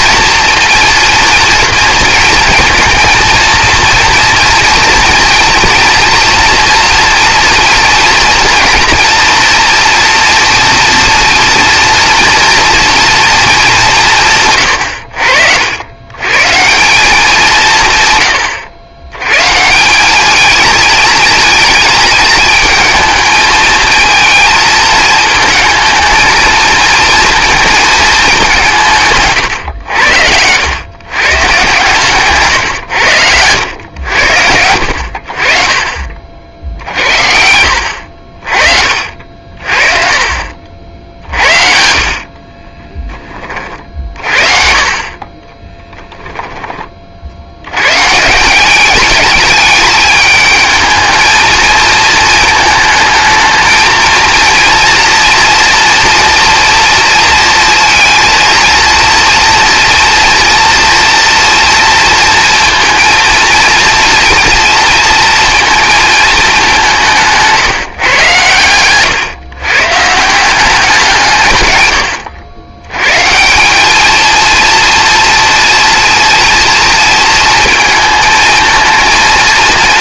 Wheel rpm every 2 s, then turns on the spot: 230, 230, 230, 240, 230, 230, 230, 100, 180, 110, 220, 220, 220, 230, 160, 120, 120, 80, 50, 50, 60, 20, 40, 30, 200, 220, 220, 230, 230, 230, 230, 230, 230, 190, 120, 180, 120, 230, 230, 230.
42-44